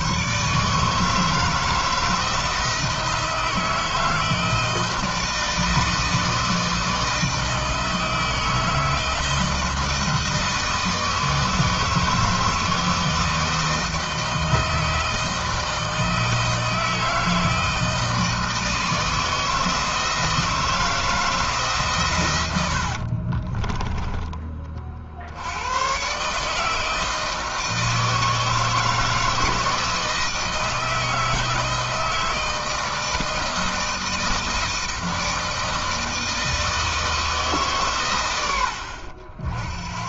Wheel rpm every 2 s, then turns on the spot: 160, 160, 160, 160, 160, 160, 160, 160, 160, 160, 160, 50, 70, 160, 160, 160, 160, 160, 160, 70.
22-24